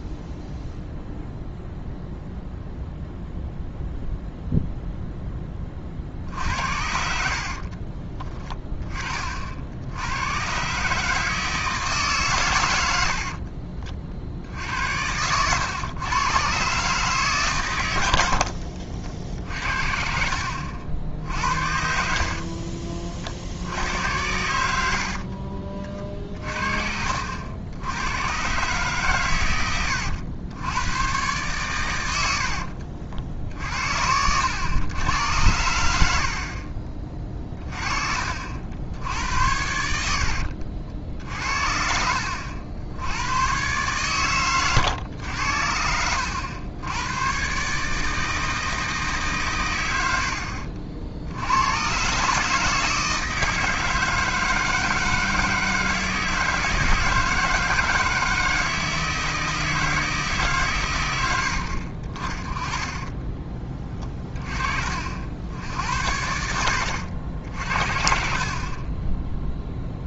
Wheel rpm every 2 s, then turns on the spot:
0, 0, 0, 60, 20, 120, 110, 80, 140, 80, 60, 40, 80, 40, 120, 100, 70, 90, 40, 60, 60, 80, 120, 90, 160, 60, 150, 160, 160, 160, 140, 30, 30, 80, 40.
6-8 18-20 22-24 26-28 32-34 40-42